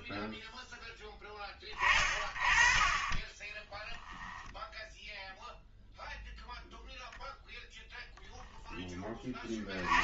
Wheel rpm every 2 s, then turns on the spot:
0, 40, 0, 0, 10.
none